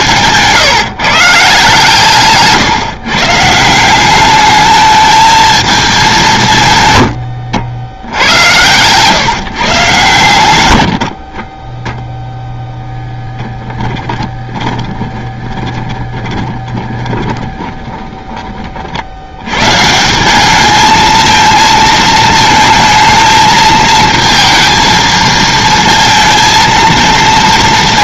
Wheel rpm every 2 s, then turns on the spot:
150, 150, 210, 120, 110, 90, 0, 20, 30, 30, 220, 220, 220, 220.
14-18